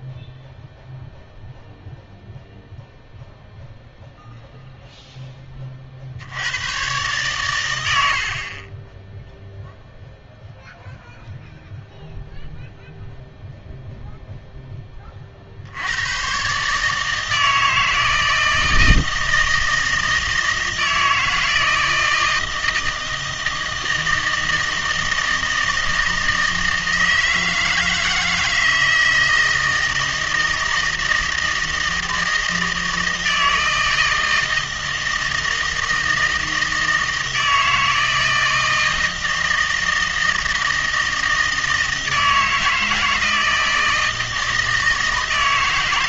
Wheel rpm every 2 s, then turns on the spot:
0, 0, 0, 100, 30, 0, 0, 10, 140, 160, 160, 160, 160, 160, 160, 160, 160, 160, 160, 160, 160, 160, 160.
none